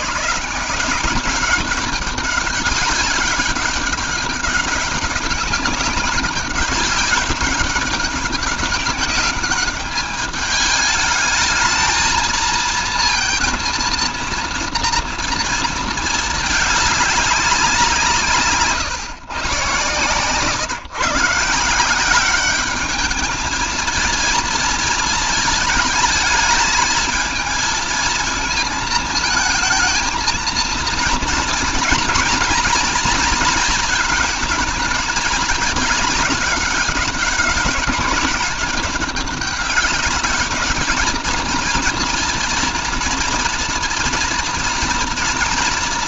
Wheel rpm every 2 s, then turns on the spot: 170, 200, 190, 190, 200, 210, 230, 230, 210, 150, 150, 210, 230, 220, 230, 230, 230, 220, 200, 200, 210, 230, 230.
none